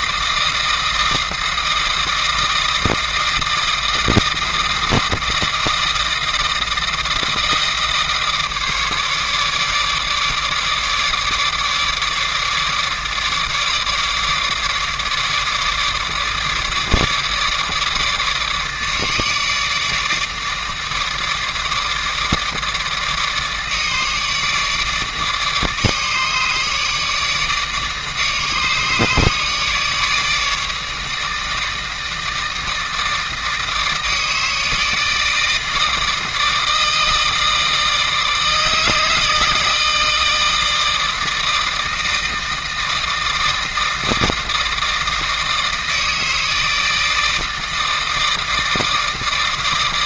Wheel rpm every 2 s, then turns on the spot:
160, 160, 160, 160, 150, 150, 150, 150, 150, 150, 150, 150, 150, 150, 150, 150, 160, 160, 160, 160, 160, 160, 160, 160, 160.
none